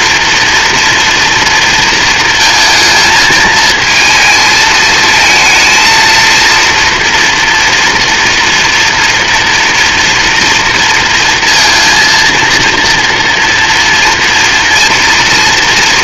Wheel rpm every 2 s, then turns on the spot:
230, 230, 220, 230, 240, 230, 230, 230.
none